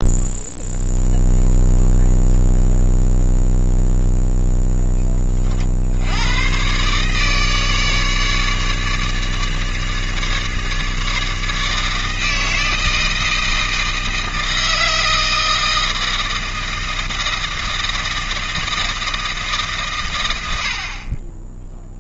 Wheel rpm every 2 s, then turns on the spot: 0, 0, 10, 140, 150, 150, 160, 160, 160, 160, 50.
none